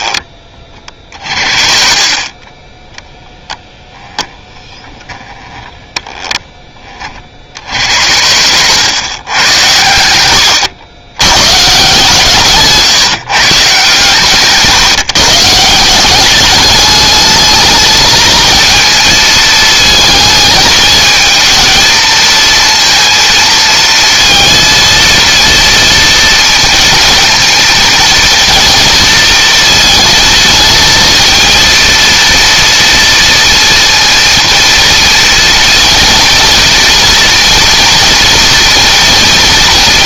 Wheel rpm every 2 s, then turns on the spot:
30, 10, 10, 10, 110, 90, 170, 140, 210, 220, 220, 230, 230, 230, 230, 220, 230, 230, 230, 230.
0-4